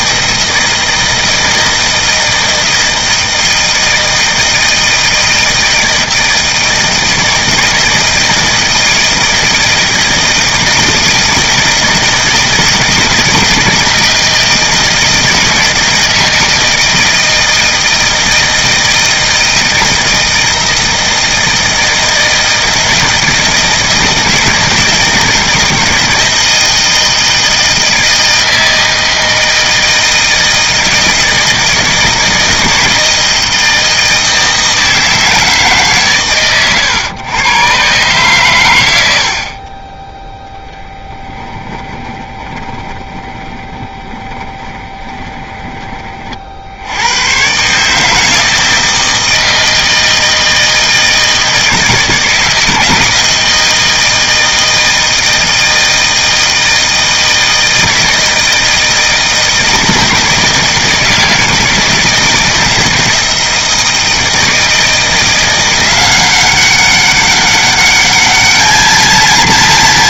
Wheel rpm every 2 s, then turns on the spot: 160, 160, 160, 160, 160, 160, 160, 160, 160, 160, 160, 160, 160, 160, 160, 160, 160, 160, 130, 100, 10, 20, 20, 90, 160, 160, 160, 160, 160, 160, 160, 160, 170, 200, 220.
40-46